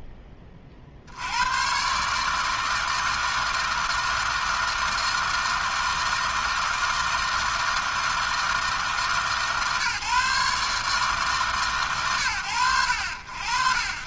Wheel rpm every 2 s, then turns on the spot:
90, 160, 160, 160, 150, 150, 80.
none